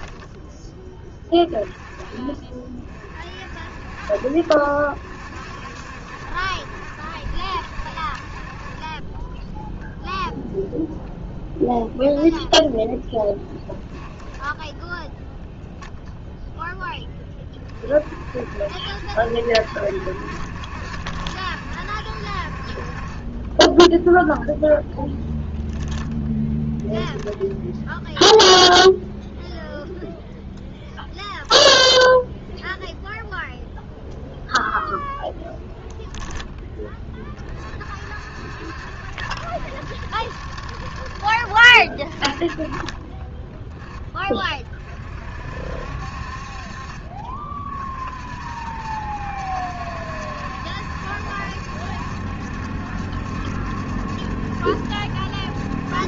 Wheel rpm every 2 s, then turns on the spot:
20, 40, 60, 70, 20, 10, 10, 0, 10, 70, 70, 40, 0, 10, 0, 0, 0, 0, 10, 50, 30, 0, 30, 40, 60, 70, 70, 70.
12-14 26-28